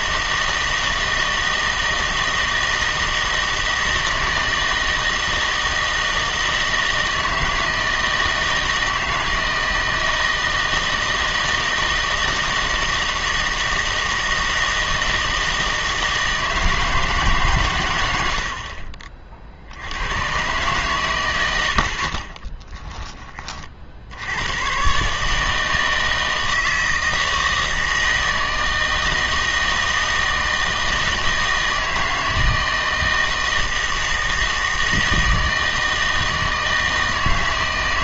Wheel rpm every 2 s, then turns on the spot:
160, 160, 160, 160, 160, 160, 160, 160, 160, 60, 130, 20, 120, 160, 160, 160, 160, 160, 160.
18-20 22-24